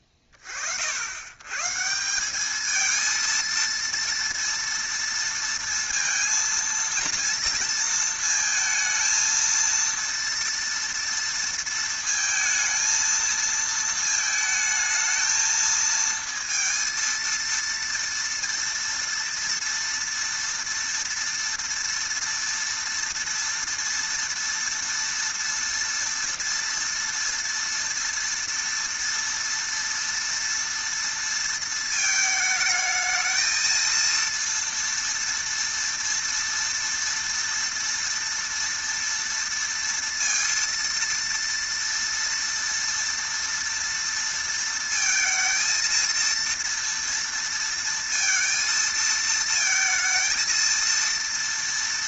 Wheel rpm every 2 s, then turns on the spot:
30, 210, 230, 230, 220, 230, 230, 220, 230, 230, 230, 230, 230, 230, 230, 230, 220, 230, 230, 240, 230, 230, 230, 230, 230, 230.
none